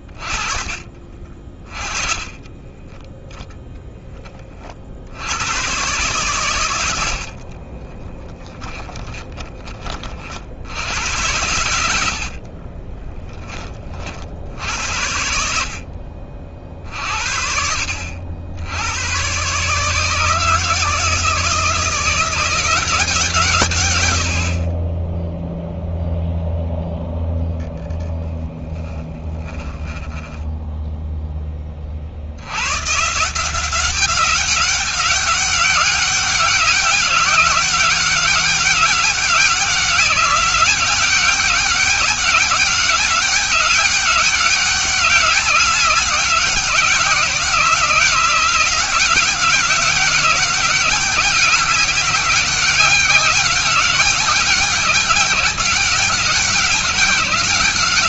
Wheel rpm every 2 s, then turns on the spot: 30, 10, 60, 80, 20, 80, 30, 80, 50, 100, 160, 180, 20, 0, 10, 10, 140, 200, 190, 200, 200, 200, 190, 180, 190, 190, 190, 190, 190.
0-2 6-10 12-14 28-30